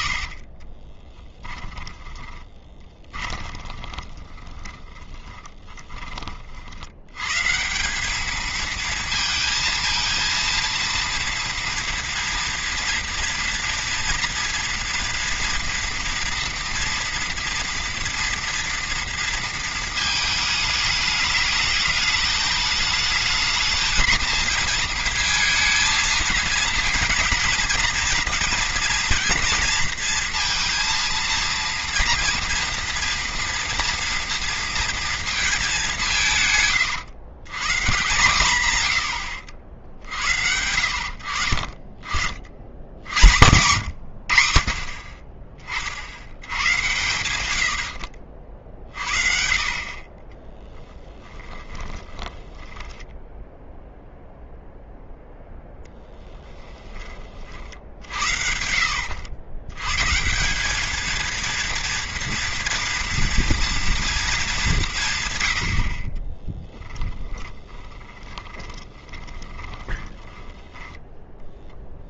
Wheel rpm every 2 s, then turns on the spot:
40, 20, 20, 60, 220, 230, 230, 230, 230, 240, 210, 210, 230, 220, 230, 230, 230, 230, 130, 120, 80, 70, 70, 90, 60, 20, 20, 0, 10, 70, 200, 230, 210, 20, 30, 10.
0-6 50-54 56-58 66-72